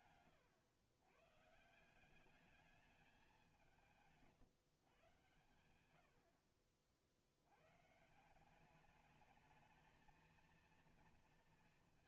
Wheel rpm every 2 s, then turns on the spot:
110, 210, 140, 60, 190, 230.
none